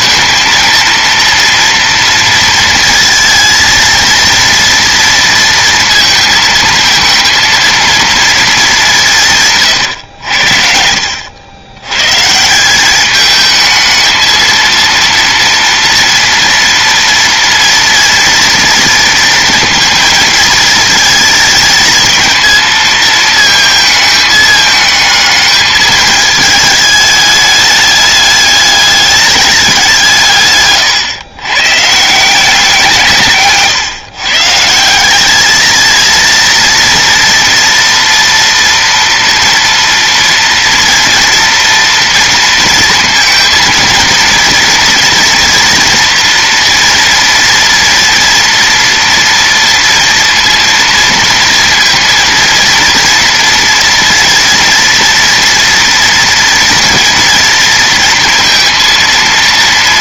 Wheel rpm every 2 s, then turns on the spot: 230, 230, 230, 230, 150, 80, 210, 230, 230, 230, 230, 220, 210, 210, 210, 120, 160, 200, 230, 230, 230, 220, 230, 230, 240, 230, 230, 230, 230, 230.
none